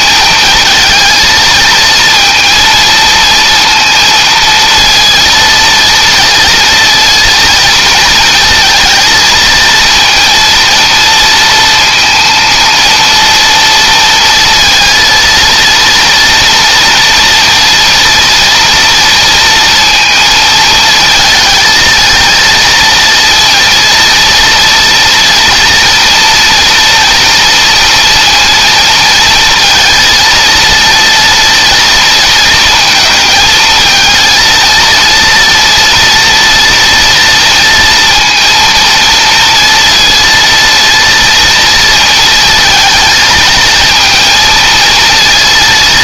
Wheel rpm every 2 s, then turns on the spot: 220, 230, 230, 230, 230, 230, 230, 230, 230, 230, 220, 230, 230, 240, 230, 230, 220, 230, 230, 230, 230, 230, 230.
none